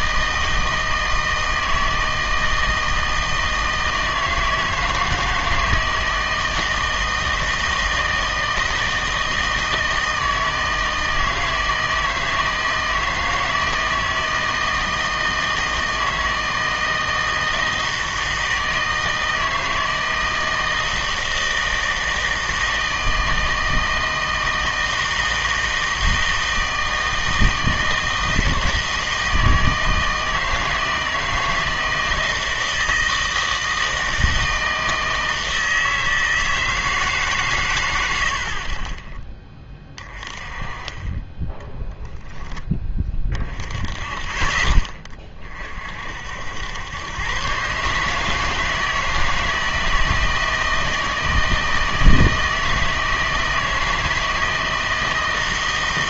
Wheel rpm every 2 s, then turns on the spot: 160, 160, 160, 160, 160, 160, 160, 160, 160, 160, 160, 160, 160, 160, 160, 160, 160, 160, 160, 60, 20, 10, 20, 80, 160, 160, 160, 160.
none